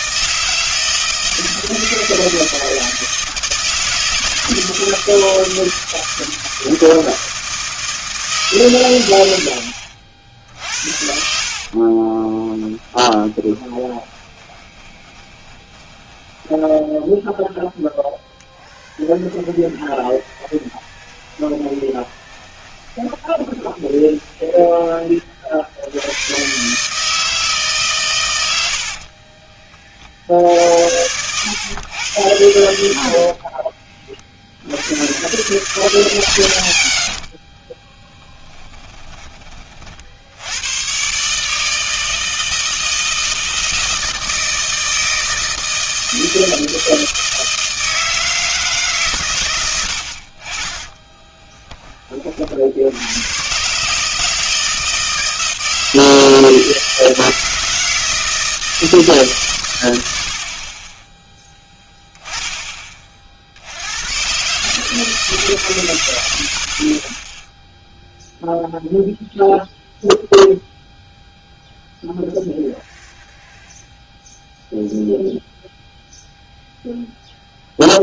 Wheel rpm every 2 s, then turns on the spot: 160, 160, 160, 160, 140, 60, 20, 20, 10, 0, 10, 20, 20, 120, 90, 70, 100, 60, 130, 10, 90, 160, 160, 160, 160, 40, 50, 160, 160, 160, 60, 10, 130, 50, 0, 0, 0, 0, 0.
12-18 20-26 38-40